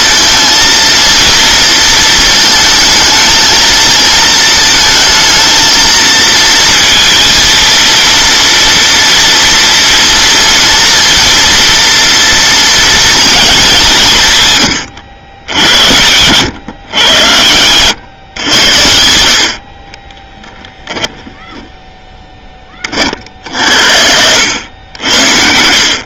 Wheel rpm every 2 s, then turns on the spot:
230, 230, 220, 230, 230, 230, 230, 130, 110, 90, 0, 20, 80.
none